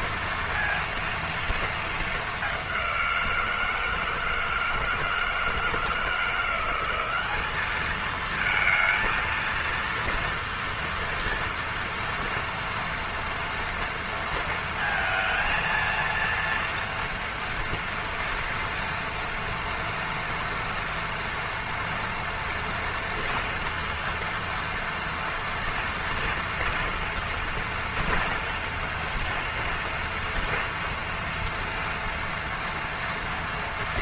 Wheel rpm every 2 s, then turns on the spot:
230, 210, 160, 170, 220, 230, 230, 230, 230, 230, 230, 230, 230, 230, 230, 230, 240.
none